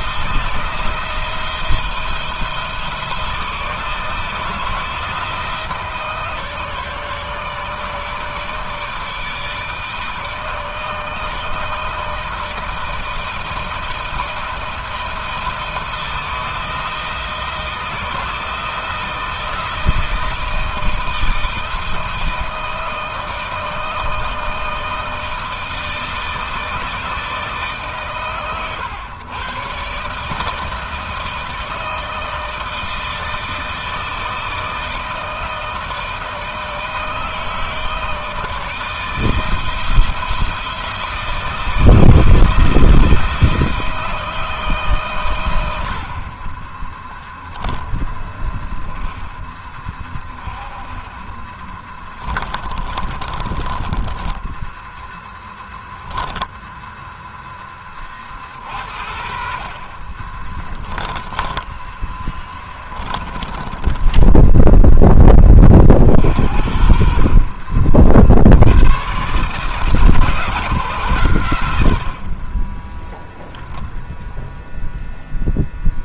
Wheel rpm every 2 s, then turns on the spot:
170, 170, 170, 150, 160, 160, 160, 170, 160, 170, 160, 160, 160, 160, 110, 160, 160, 160, 160, 160, 160, 170, 120, 10, 10, 30, 30, 10, 0, 60, 10, 20, 10, 50, 110, 110, 10, 0.
50-56 62-64